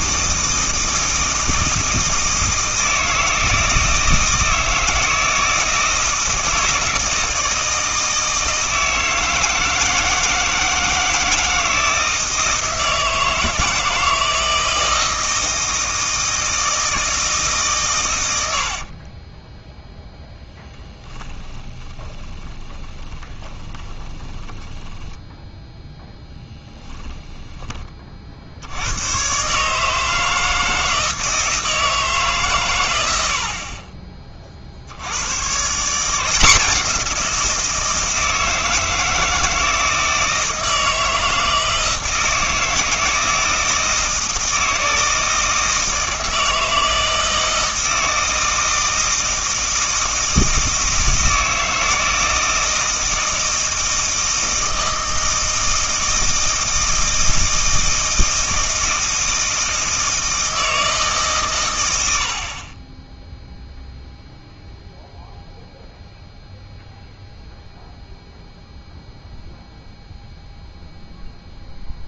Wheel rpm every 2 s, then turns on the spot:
160, 160, 160, 160, 160, 160, 160, 160, 160, 50, 10, 20, 10, 10, 90, 160, 110, 70, 180, 160, 160, 160, 160, 160, 160, 160, 160, 160, 160, 160, 160, 20, 0, 0, 0, 0.
18-26